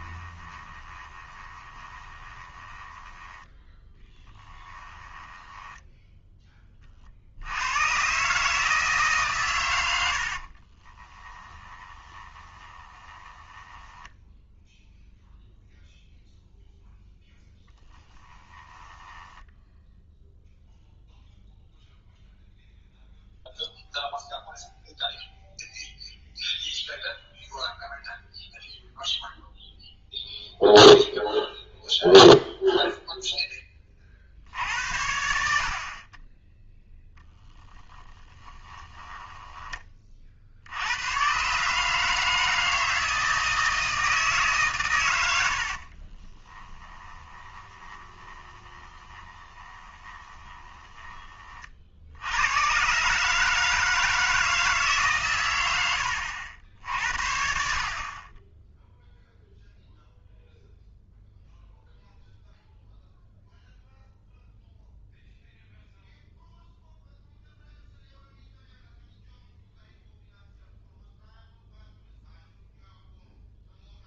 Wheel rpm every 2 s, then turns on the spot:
20, 20, 20, 40, 150, 30, 20, 0, 0, 10, 0, 0, 0, 0, 0, 0, 0, 70, 10, 20, 90, 160, 120, 20, 20, 20, 130, 150, 60, 0, 0, 0, 0, 0, 0, 0, 0.
0-6 10-14 18-20 38-40 46-50